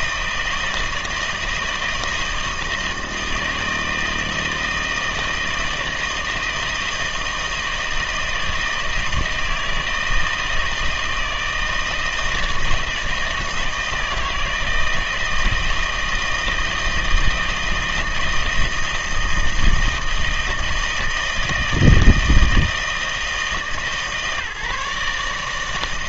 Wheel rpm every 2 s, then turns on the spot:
160, 160, 160, 160, 160, 160, 160, 160, 160, 160, 160, 160, 150.
none